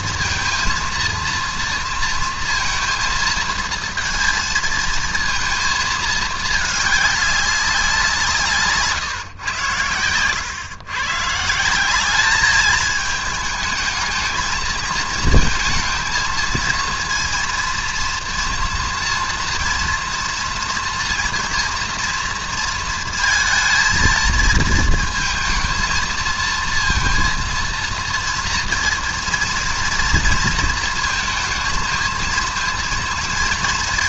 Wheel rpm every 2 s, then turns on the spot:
230, 230, 230, 220, 180, 120, 210, 220, 230, 230, 230, 230, 230, 230, 230, 220, 230.
none